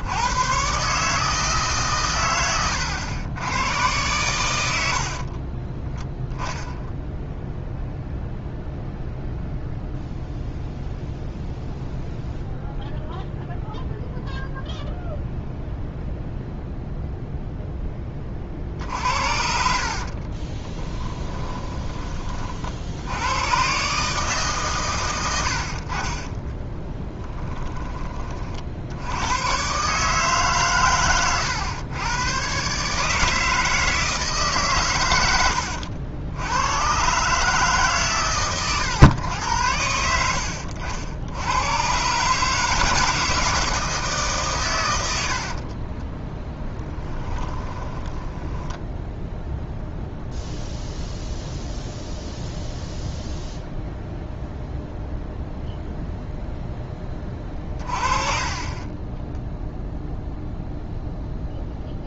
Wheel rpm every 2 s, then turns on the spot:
130, 110, 80, 10, 0, 0, 0, 0, 0, 50, 20, 60, 140, 20, 50, 130, 140, 140, 100, 130, 60, 150, 130, 20, 10, 0, 0, 0, 0, 30, 0.
20-22 26-28 46-50